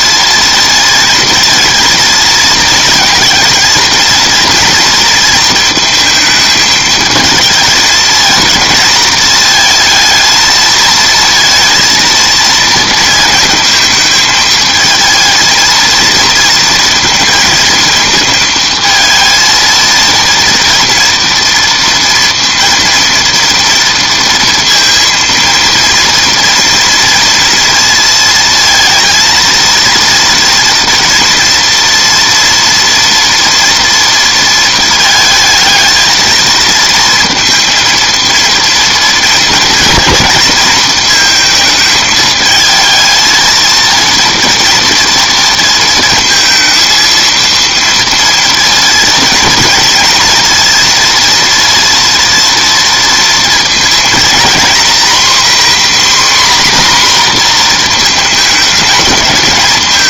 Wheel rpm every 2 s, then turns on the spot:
230, 220, 230, 220, 220, 220, 230, 220, 230, 220, 230, 230, 230, 230, 220, 230, 230, 230, 230, 230, 230, 220, 230, 220, 230, 230, 230, 230, 260, 220.
none